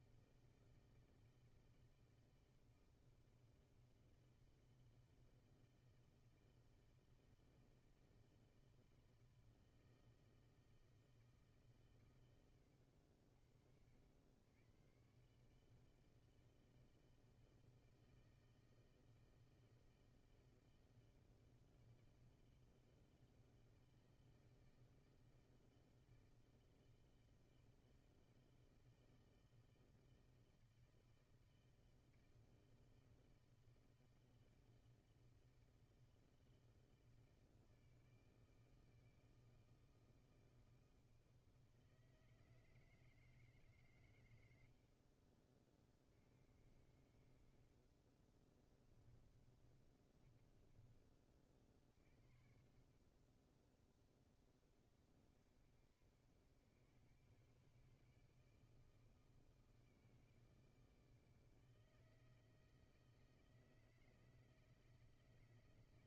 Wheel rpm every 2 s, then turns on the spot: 160, 160, 160, 160, 160, 160, 110, 100, 160, 160, 160, 160, 160, 160, 160, 160, 160, 160, 160, 160, 160, 160, 100, 60, 20, 30, 60, 30, 90, 160, 160, 160, 160.
48-52